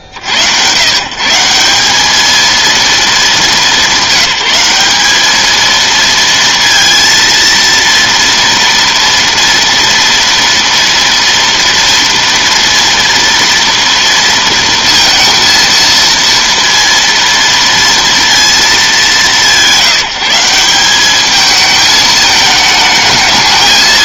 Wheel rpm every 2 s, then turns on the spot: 90, 230, 200, 230, 230, 230, 230, 230, 230, 190, 200, 220.
none